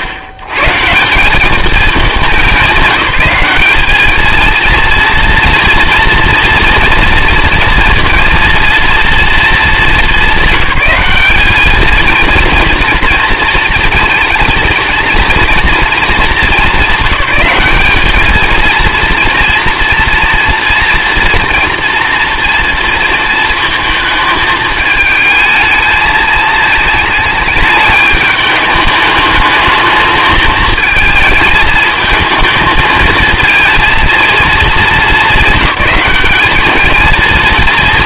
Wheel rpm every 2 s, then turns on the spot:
110, 190, 230, 230, 230, 200, 230, 220, 220, 230, 230, 230, 220, 220, 210, 220, 220, 220, 220.
none